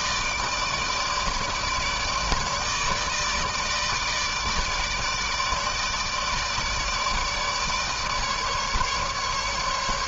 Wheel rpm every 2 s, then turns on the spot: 150, 150, 150, 160, 150.
none